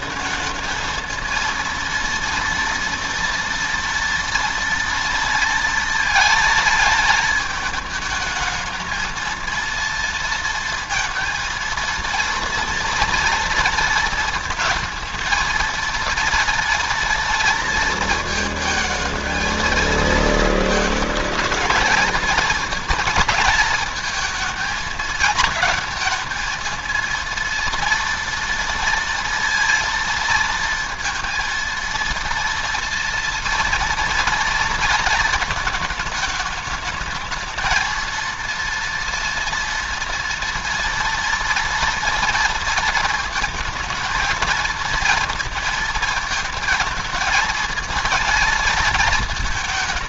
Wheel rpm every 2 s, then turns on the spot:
220, 230, 230, 230, 220, 230, 230, 220, 230, 220, 220, 230, 220, 220, 230, 230, 230, 230, 220, 230, 230, 230, 230, 220, 230.
none